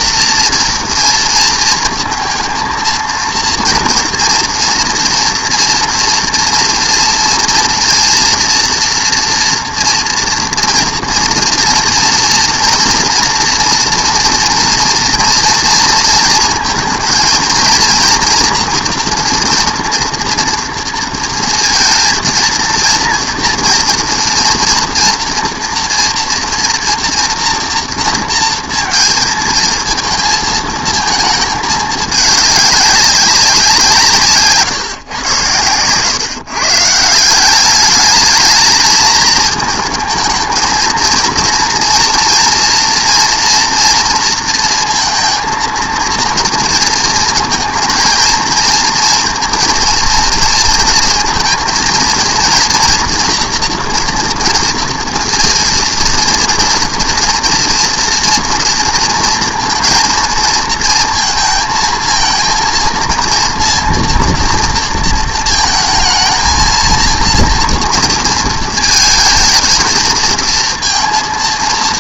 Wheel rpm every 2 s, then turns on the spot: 230, 230, 240, 230, 230, 240, 230, 240, 230, 240, 240, 230, 230, 230, 230, 220, 200, 150, 140, 220, 220, 230, 230, 230, 230, 230, 230, 230, 230, 230, 230, 230, 230, 230, 220, 230.
none